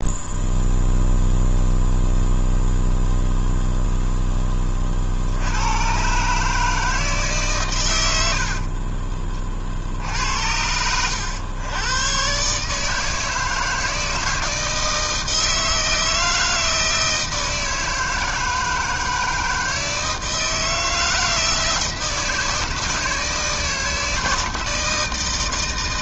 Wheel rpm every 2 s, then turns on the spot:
0, 0, 10, 150, 70, 80, 140, 160, 160, 160, 160, 160, 160.
none